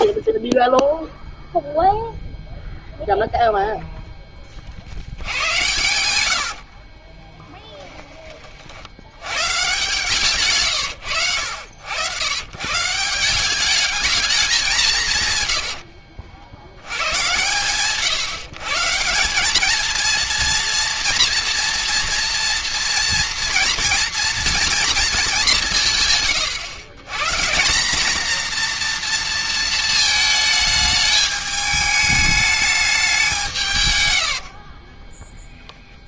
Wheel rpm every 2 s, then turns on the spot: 10, 0, 40, 70, 50, 140, 130, 200, 90, 150, 230, 230, 230, 130, 230, 210, 210, 60.
6-8 34-36